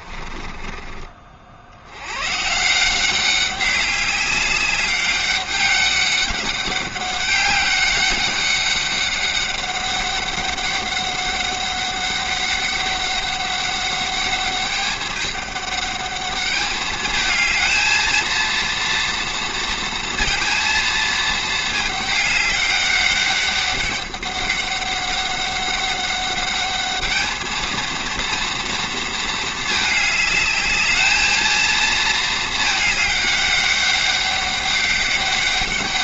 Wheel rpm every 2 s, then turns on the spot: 30, 140, 200, 200, 200, 200, 200, 210, 210, 230, 230, 200, 200, 200, 230, 210, 220, 200.
0-2